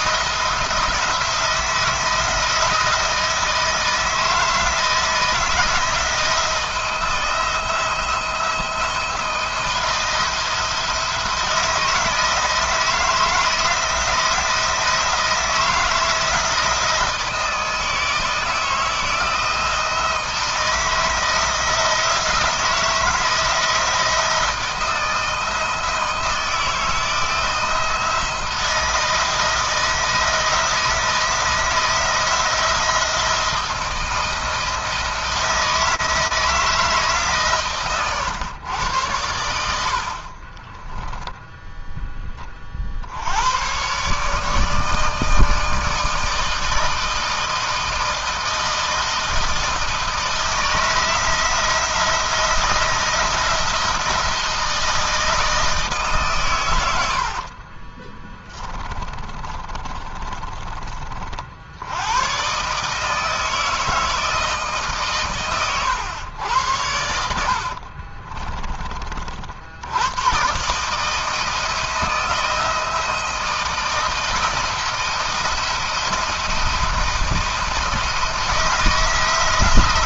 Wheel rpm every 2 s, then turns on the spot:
160, 160, 160, 170, 170, 170, 160, 170, 170, 160, 160, 160, 160, 160, 160, 160, 170, 160, 160, 100, 30, 50, 150, 160, 160, 160, 170, 160, 110, 20, 30, 130, 150, 90, 30, 140, 160, 160, 170, 160.
40-42 58-60